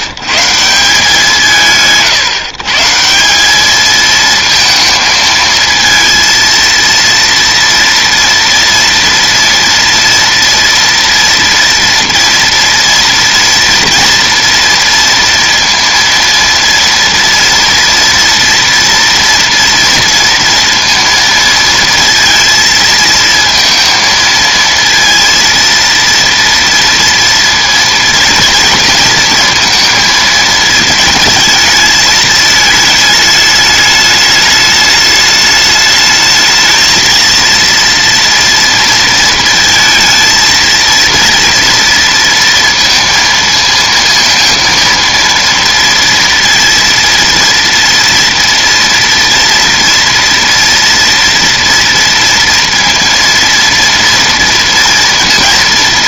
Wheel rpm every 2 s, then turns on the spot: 150, 150, 230, 230, 230, 230, 240, 230, 230, 230, 230, 230, 230, 230, 230, 220, 220, 210, 220, 230, 230, 230, 230, 230, 230, 230, 230, 230.
none